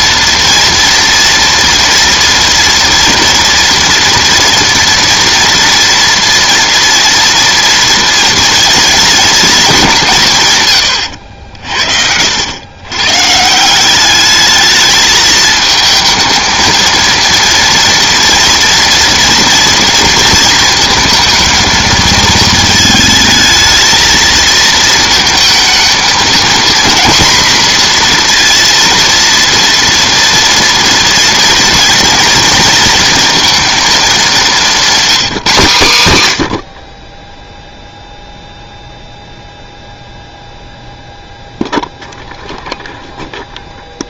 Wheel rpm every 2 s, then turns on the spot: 230, 240, 230, 230, 230, 130, 100, 210, 220, 230, 230, 220, 220, 230, 230, 230, 230, 210, 100, 0, 0, 0.
none